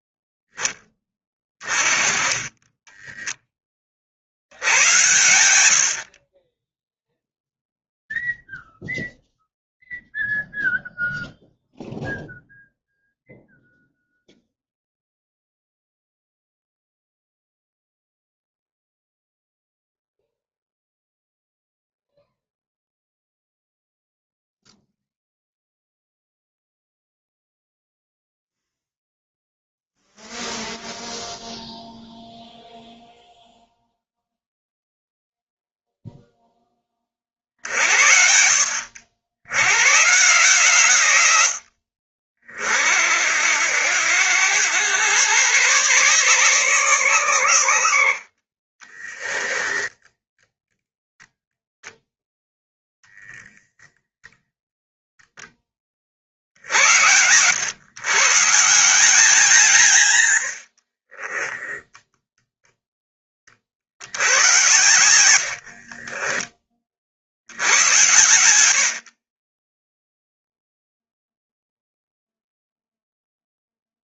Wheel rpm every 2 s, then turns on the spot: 10, 20, 80, 10, 0, 0, 0, 0, 0, 0, 0, 0, 0, 0, 0, 0, 0, 0, 10, 70, 140, 50, 100, 150, 40, 10, 0, 0, 60, 160, 80, 0, 90, 30, 90, 0, 0.
60-62 64-66